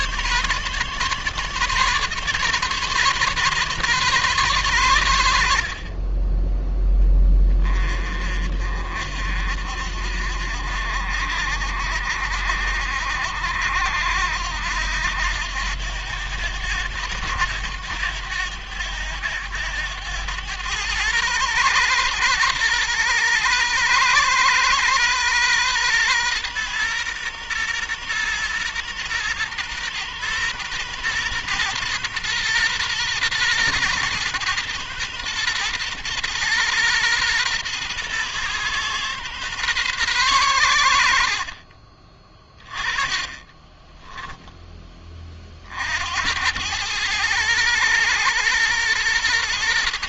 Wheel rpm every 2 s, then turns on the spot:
140, 140, 100, 20, 50, 60, 70, 80, 90, 90, 110, 120, 120, 120, 120, 120, 120, 120, 120, 120, 90, 20, 20, 110, 120.
42-44